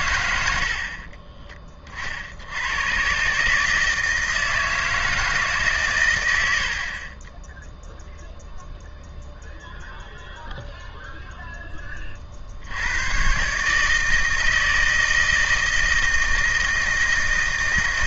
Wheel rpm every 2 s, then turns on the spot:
40, 100, 160, 40, 0, 0, 90, 160, 160.
none